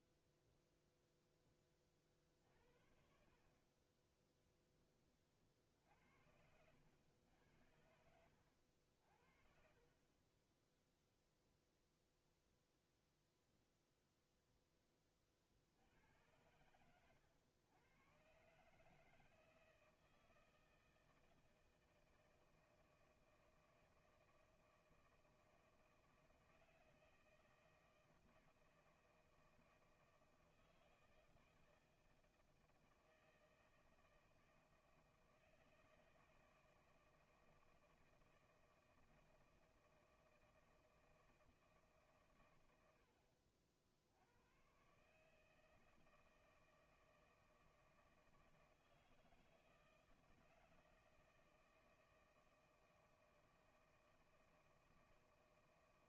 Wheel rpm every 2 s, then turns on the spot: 0, 60, 30, 90, 60, 0, 0, 20, 100, 160, 160, 160, 160, 160, 160, 160, 160, 160, 160, 160, 160, 90, 130, 160, 160, 160, 160, 160.
none